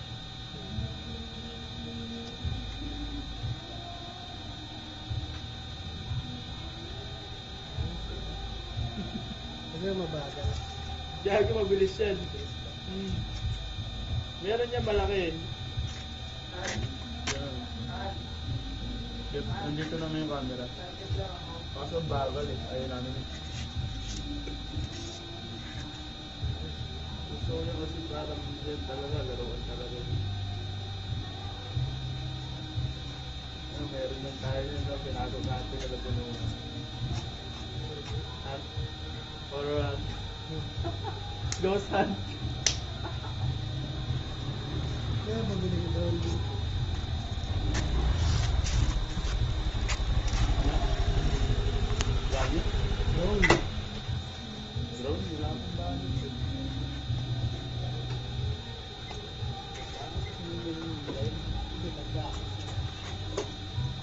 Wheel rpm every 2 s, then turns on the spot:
0, 0, 0, 0, 0, 0, 0, 0, 0, 0, 0, 0, 0, 0, 0, 0, 0, 0, 0, 0, 0, 0, 0, 0, 0, 0, 0, 0, 0, 0, 0, 0.
none